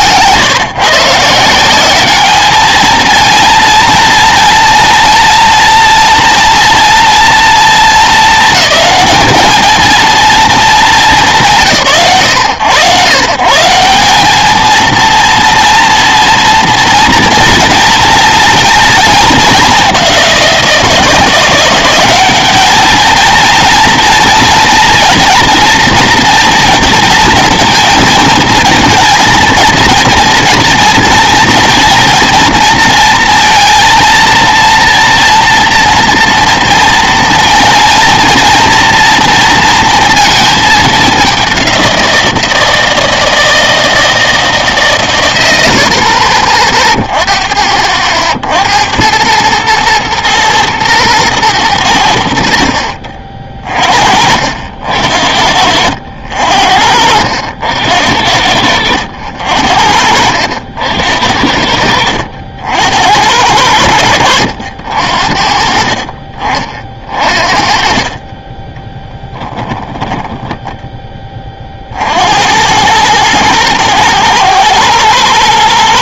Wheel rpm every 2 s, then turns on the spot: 150, 220, 230, 230, 220, 210, 120, 230, 240, 220, 170, 220, 230, 230, 230, 230, 230, 230, 230, 230, 210, 160, 130, 30, 80, 110, 50, 70, 60, 80, 70, 70, 80, 40, 10, 10, 100, 110.
68-70